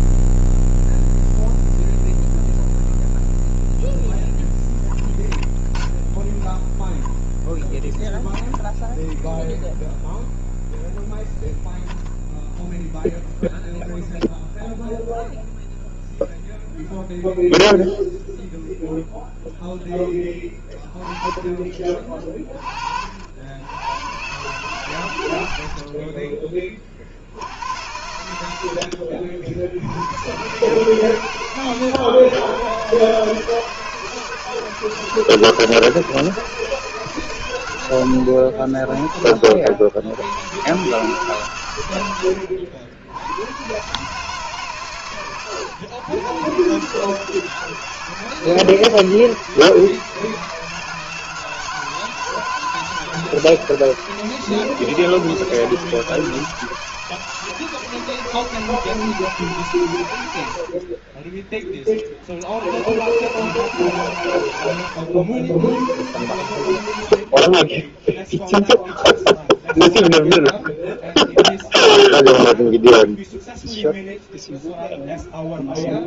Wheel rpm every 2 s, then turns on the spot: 0, 0, 0, 10, 0, 0, 0, 0, 0, 0, 20, 50, 120, 30, 80, 130, 120, 160, 160, 40, 120, 70, 140, 140, 160, 160, 160, 160, 160, 160, 50, 90, 100, 90, 0, 0, 0, 0.
60-62